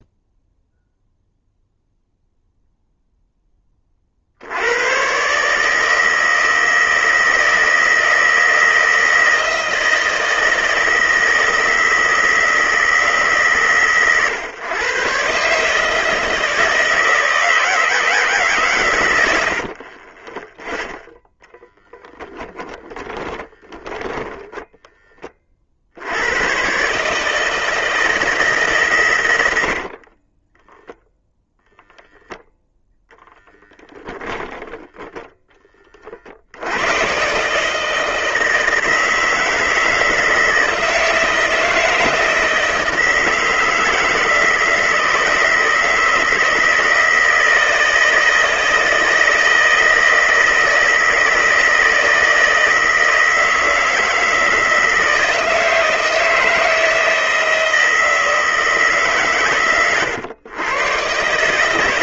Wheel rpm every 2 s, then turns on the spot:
0, 0, 90, 160, 160, 160, 160, 130, 160, 140, 10, 20, 10, 130, 150, 10, 0, 10, 80, 160, 160, 160, 160, 160, 160, 160, 160, 160, 160, 160, 110.
22-24 30-32